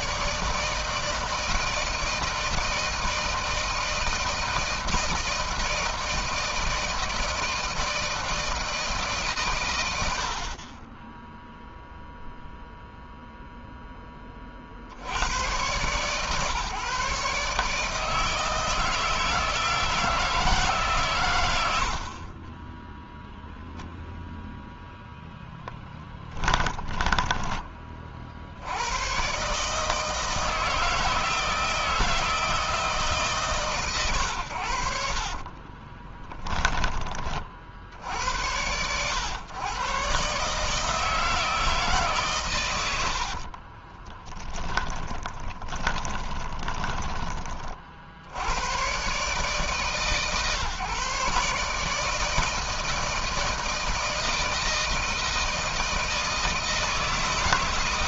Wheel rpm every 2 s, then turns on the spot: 160, 160, 160, 160, 140, 20, 0, 80, 140, 160, 130, 0, 10, 30, 150, 160, 130, 20, 50, 120, 150, 30, 10, 50, 140, 150, 160, 160, 160.
24-26 34-36 42-46